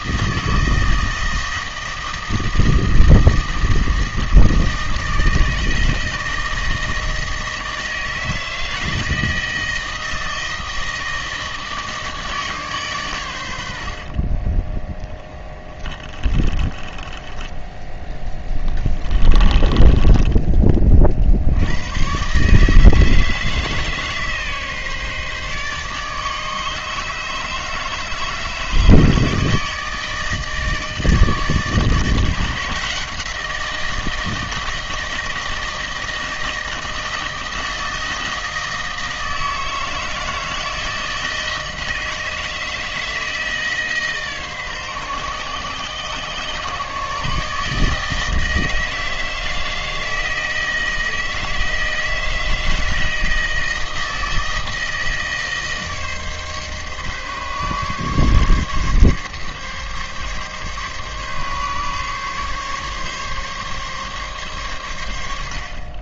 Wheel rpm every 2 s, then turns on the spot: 160, 160, 160, 160, 160, 160, 140, 40, 30, 20, 30, 150, 150, 150, 150, 160, 160, 160, 160, 160, 160, 160, 140, 130, 160, 160, 160, 160, 140, 140, 140, 140, 130.
14-20